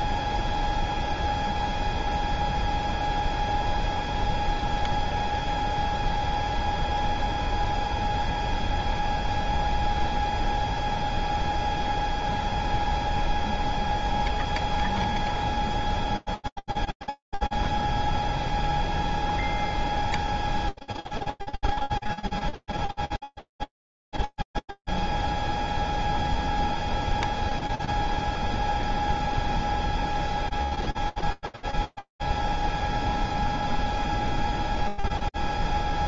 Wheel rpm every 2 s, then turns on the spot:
0, 0, 0, 0, 0, 0, 0, 0, 0, 0, 0, 0, 0, 0, 0, 0, 0, 0.
none